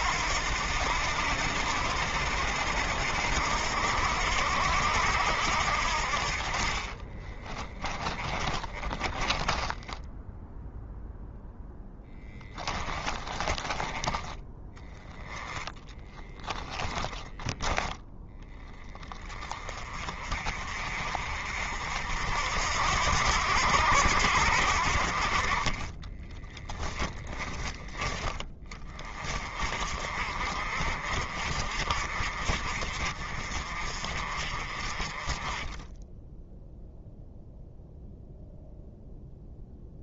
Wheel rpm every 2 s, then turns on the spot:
80, 80, 80, 40, 20, 0, 20, 10, 10, 20, 40, 80, 60, 20, 30, 50, 50, 40, 0, 0.
6-10 12-14 26-28